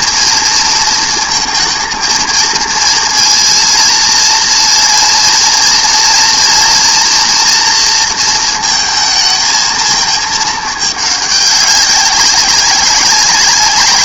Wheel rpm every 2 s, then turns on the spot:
230, 230, 230, 230, 230, 220, 190.
none